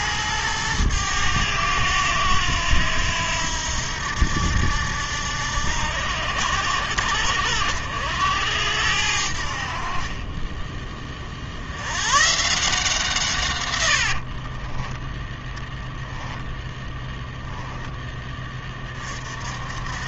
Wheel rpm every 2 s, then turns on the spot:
110, 90, 80, 70, 80, 20, 150, 30, 10, 30.
14-18